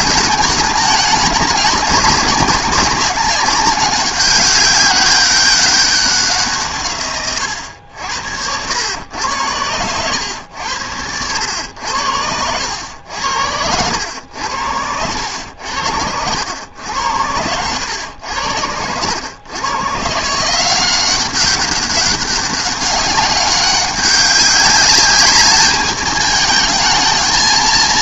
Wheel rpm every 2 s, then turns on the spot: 210, 190, 200, 160, 100, 90, 90, 80, 100, 90, 180, 200, 200, 220.
none